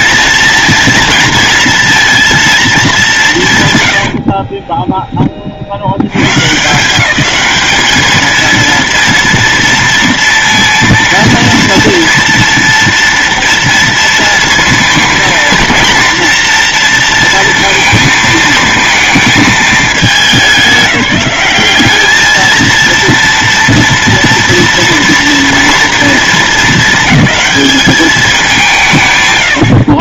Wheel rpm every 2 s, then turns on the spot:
230, 220, 10, 180, 230, 230, 230, 230, 230, 230, 180, 230, 230, 220, 170.
4-6